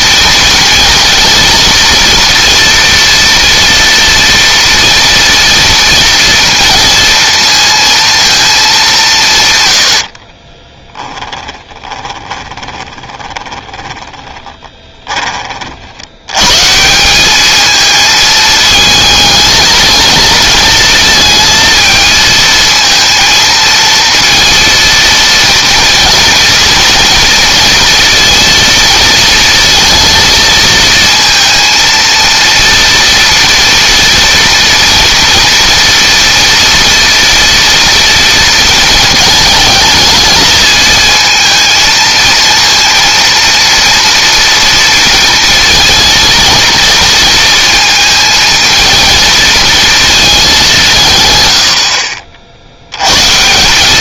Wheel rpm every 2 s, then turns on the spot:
230, 230, 230, 230, 200, 10, 10, 20, 160, 220, 230, 230, 230, 230, 230, 230, 230, 230, 230, 230, 220, 230, 230, 220, 220, 180, 80.
10-16